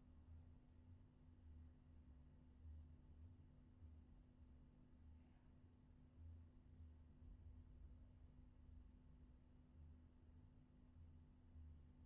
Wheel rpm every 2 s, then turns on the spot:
0, 0, 0, 0, 0, 0.
none